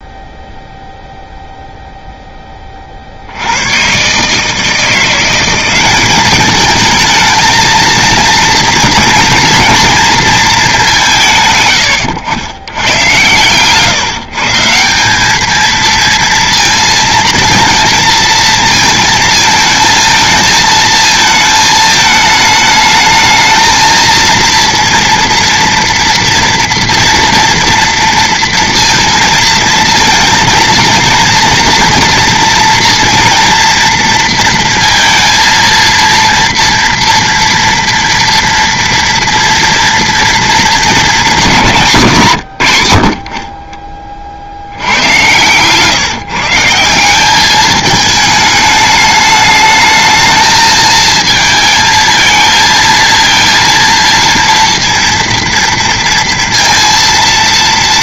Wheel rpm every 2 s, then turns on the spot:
0, 20, 150, 210, 230, 220, 100, 150, 230, 220, 220, 220, 230, 230, 230, 230, 230, 230, 230, 230, 230, 140, 60, 160, 210, 220, 230, 230, 230.
none